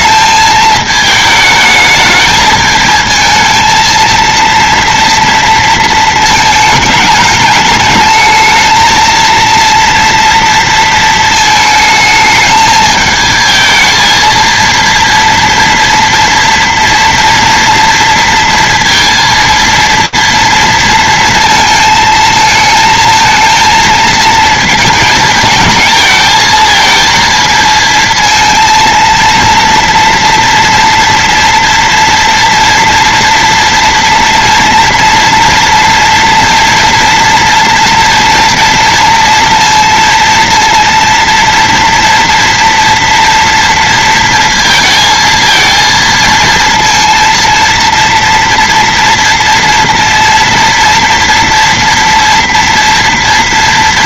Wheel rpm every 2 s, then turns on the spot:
220, 220, 240, 220, 220, 230, 220, 230, 230, 230, 230, 220, 230, 220, 230, 230, 230, 230, 230, 230, 230, 230, 230, 230, 230, 230, 230.
none